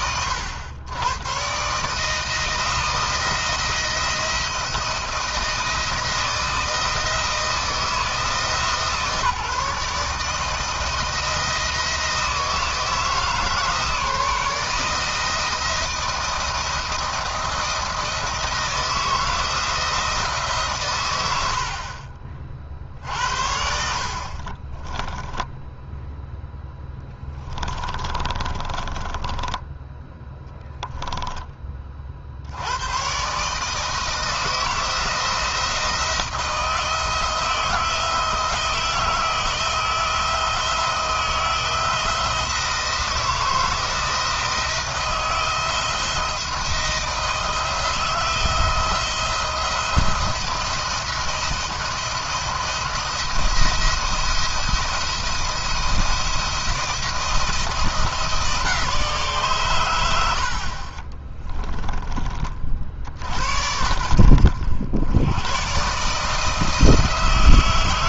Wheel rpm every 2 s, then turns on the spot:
120, 160, 170, 160, 150, 160, 160, 160, 170, 160, 120, 50, 30, 10, 20, 0, 110, 160, 160, 160, 160, 170, 160, 160, 160, 170, 170, 170, 170, 160, 40, 60, 80, 160.
24-26 28-30 60-62